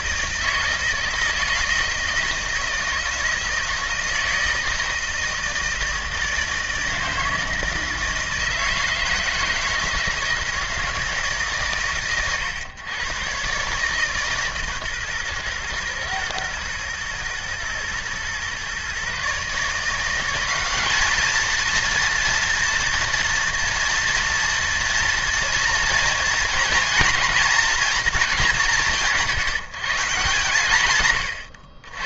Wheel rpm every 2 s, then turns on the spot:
160, 160, 160, 160, 160, 160, 110, 140, 110, 130, 200, 230, 230, 240, 190, 130.
none